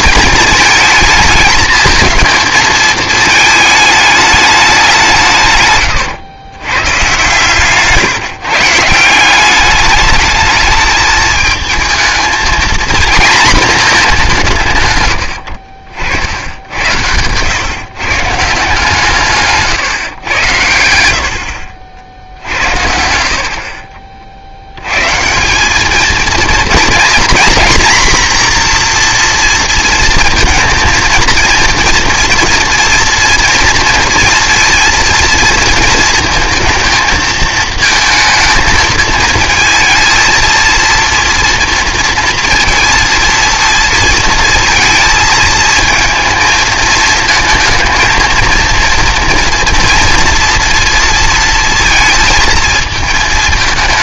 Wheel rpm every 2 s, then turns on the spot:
220, 220, 200, 120, 150, 210, 230, 160, 80, 150, 100, 70, 80, 230, 240, 230, 240, 230, 220, 220, 230, 230, 230, 220, 230, 230, 220.
none